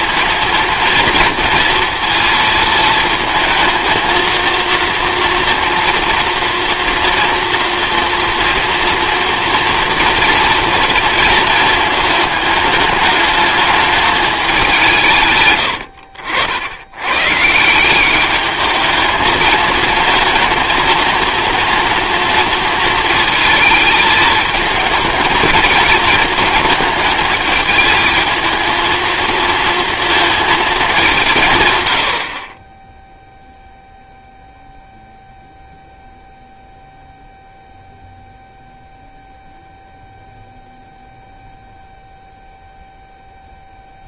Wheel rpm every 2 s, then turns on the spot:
230, 230, 230, 230, 230, 230, 210, 170, 90, 220, 230, 230, 220, 220, 230, 220, 20, 0, 0, 0, 0, 0.
none